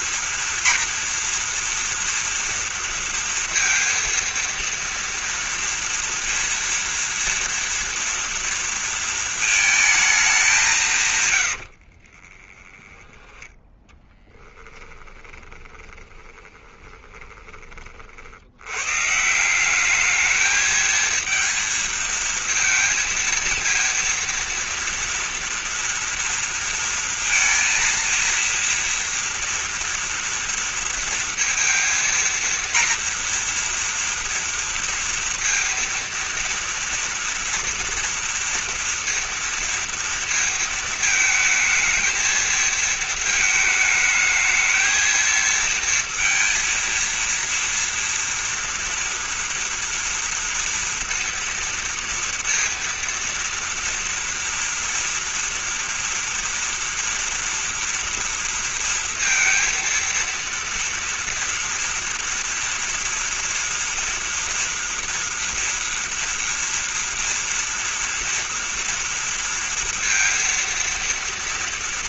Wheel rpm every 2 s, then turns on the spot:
230, 230, 230, 230, 230, 160, 20, 10, 20, 110, 220, 230, 230, 230, 230, 230, 230, 230, 230, 230, 220, 220, 220, 230, 230, 230, 230, 230, 230, 230, 230, 230, 230, 230, 230, 230.
12-18